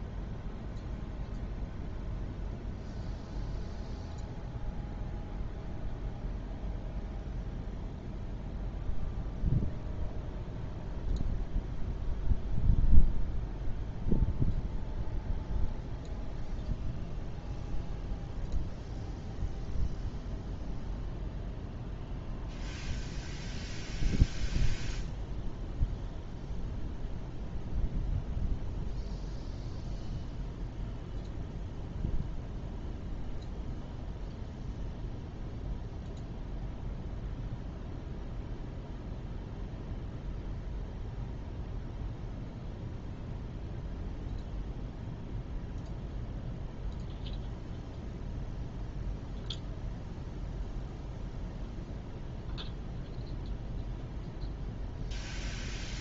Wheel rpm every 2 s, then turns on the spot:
0, 0, 0, 0, 0, 0, 0, 0, 0, 0, 0, 0, 0, 0, 0, 0, 0, 0, 0, 0, 0, 0, 0, 0, 0, 0, 0, 0.
none